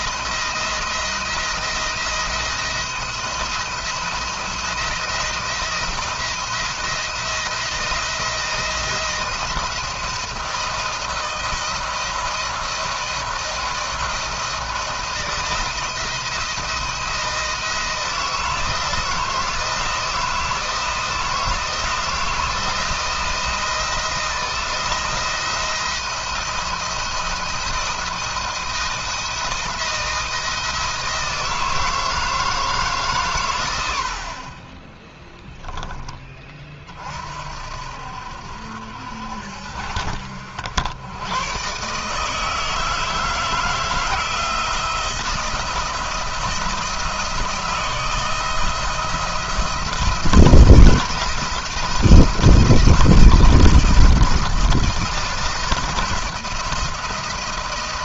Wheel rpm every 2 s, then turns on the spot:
170, 170, 170, 170, 170, 160, 170, 170, 170, 170, 160, 170, 170, 170, 170, 160, 150, 30, 40, 70, 70, 160, 160, 170, 160, 170, 160, 170, 160.
none